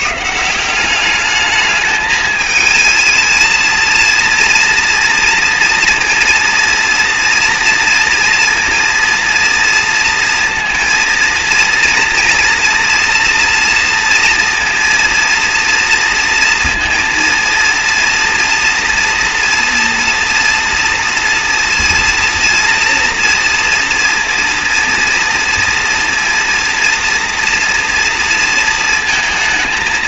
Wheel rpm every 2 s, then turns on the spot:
180, 220, 230, 230, 230, 230, 230, 230, 230, 230, 230, 230, 230, 230, 230.
none